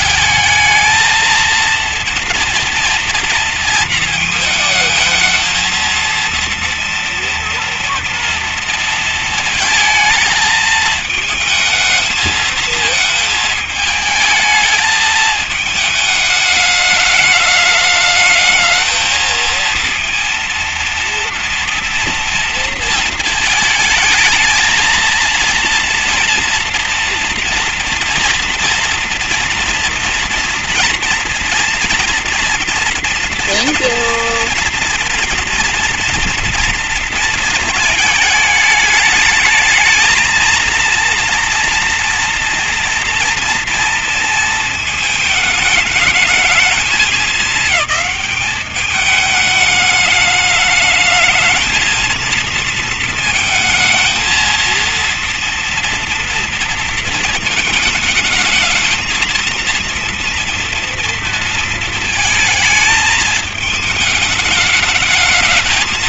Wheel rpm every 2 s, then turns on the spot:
220, 230, 220, 230, 230, 220, 220, 220, 210, 220, 230, 230, 230, 230, 230, 230, 240, 240, 230, 210, 230, 240, 220, 220, 210, 220, 230, 230, 230, 220, 230, 220, 220.
none